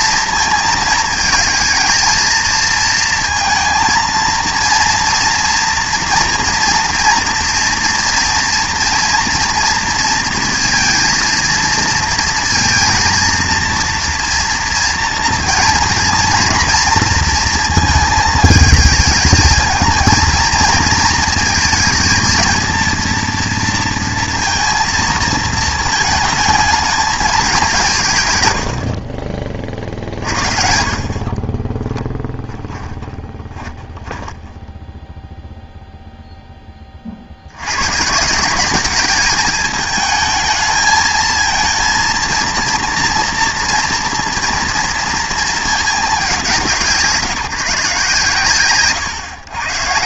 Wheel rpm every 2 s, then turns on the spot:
230, 220, 230, 230, 230, 230, 230, 230, 240, 220, 220, 220, 230, 220, 110, 50, 10, 10, 10, 190, 220, 230, 240, 170, 130.
32-36